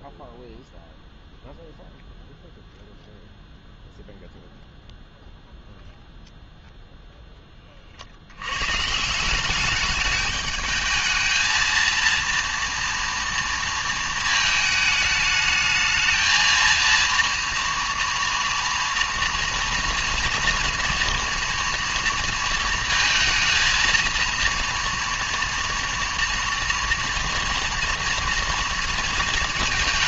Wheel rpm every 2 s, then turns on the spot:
0, 0, 0, 0, 140, 220, 230, 220, 230, 230, 230, 220, 230, 230, 230.
none